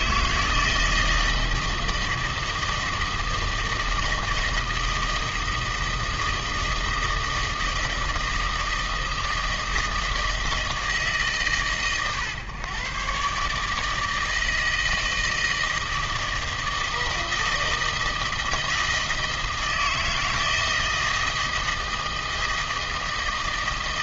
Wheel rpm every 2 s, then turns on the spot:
160, 170, 160, 160, 160, 160, 120, 160, 160, 160, 160, 160.
none